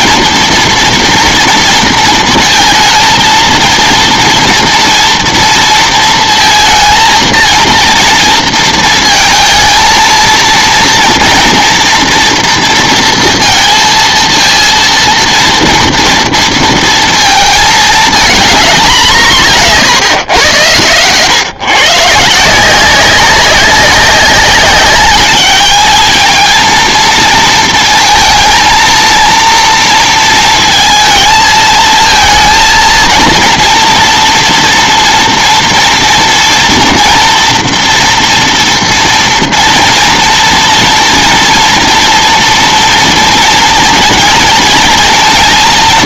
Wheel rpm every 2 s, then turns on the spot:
230, 230, 230, 230, 230, 230, 230, 230, 230, 200, 110, 180, 200, 220, 220, 230, 230, 230, 230, 230, 230, 230, 230.
none